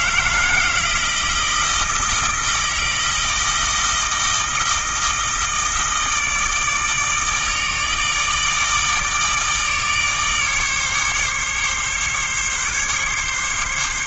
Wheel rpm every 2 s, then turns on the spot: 160, 160, 160, 160, 150, 150, 140.
none